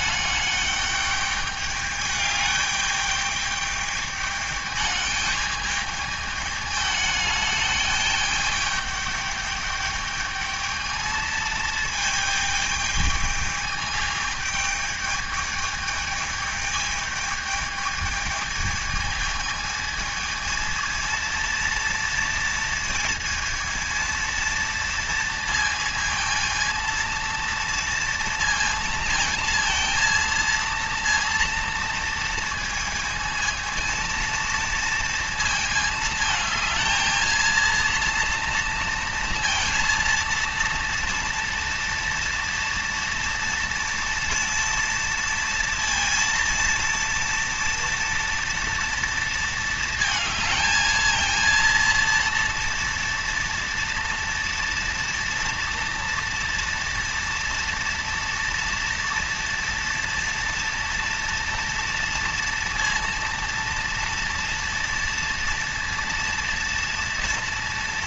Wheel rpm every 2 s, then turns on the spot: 210, 210, 210, 210, 210, 220, 220, 210, 210, 220, 230, 230, 230, 220, 230, 230, 230, 230, 220, 230, 230, 230, 230, 230, 230, 220, 230, 230, 230, 230, 230, 230, 230, 230.
none